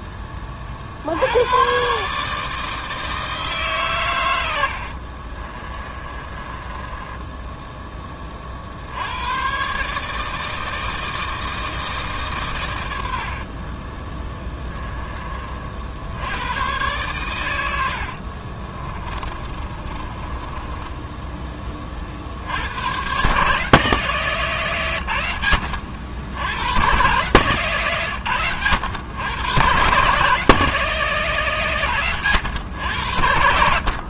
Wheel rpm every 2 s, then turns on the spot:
40, 160, 60, 10, 80, 160, 80, 20, 110, 30, 20, 110, 120, 110, 110, 160, 90.
4-8 18-22